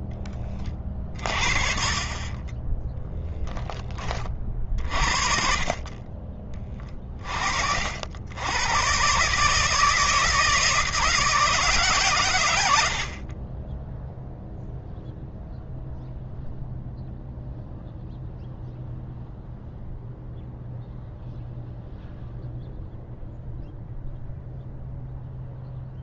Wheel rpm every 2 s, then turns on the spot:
40, 0, 40, 30, 130, 160, 50, 0, 0, 0, 0, 0, 0.
none